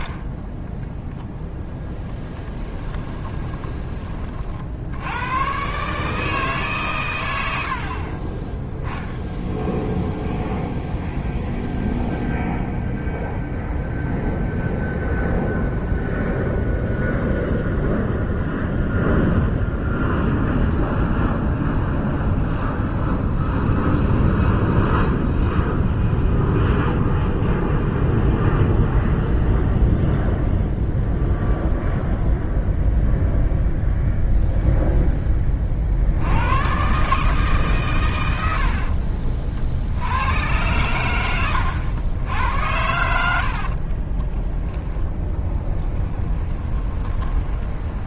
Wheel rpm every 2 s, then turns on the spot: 0, 20, 80, 130, 0, 0, 0, 0, 0, 0, 0, 0, 0, 0, 0, 0, 0, 0, 130, 60, 100, 80, 10, 20.
2-4 38-40 42-44 46-48